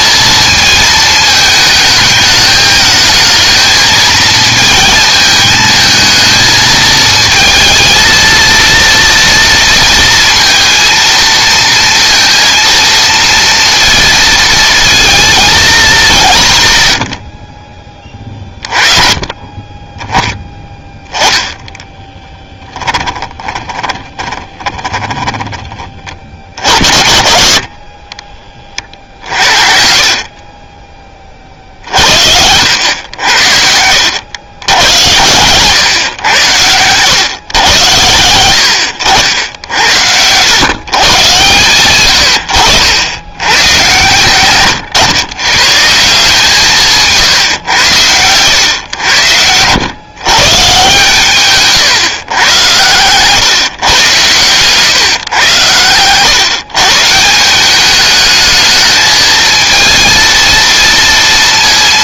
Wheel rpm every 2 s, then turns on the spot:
220, 220, 220, 220, 230, 230, 230, 220, 130, 30, 10, 10, 20, 50, 30, 20, 90, 90, 110, 90, 120, 90, 130, 160, 110, 150, 120, 130, 150, 220, 230.
20-26